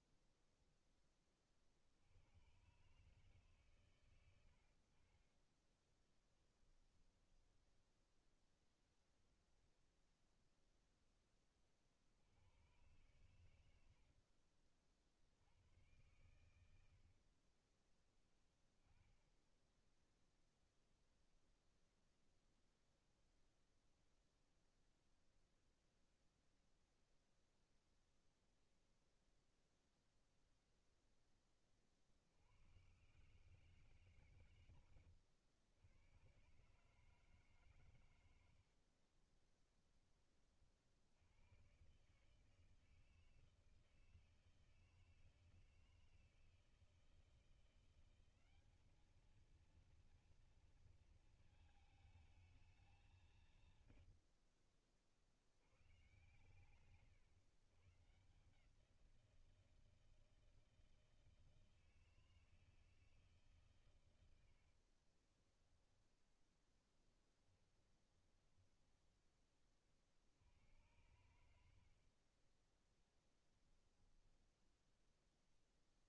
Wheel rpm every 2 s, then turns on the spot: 20, 140, 50, 10, 0, 10, 110, 60, 70, 10, 0, 0, 0, 0, 0, 0, 120, 90, 150, 40, 60, 160, 160, 160, 210, 230, 200, 50, 130, 170, 160, 160, 40, 10, 10, 90, 10, 10.
6-8 16-18 34-36 38-40 64-68